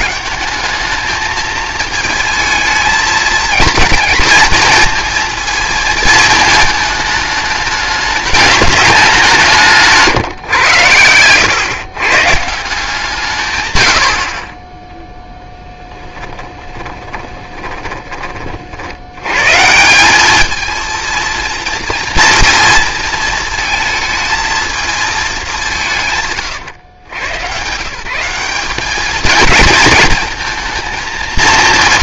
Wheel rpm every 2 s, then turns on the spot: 210, 220, 230, 220, 210, 110, 160, 20, 10, 60, 220, 230, 220, 120, 200, 230.
16-18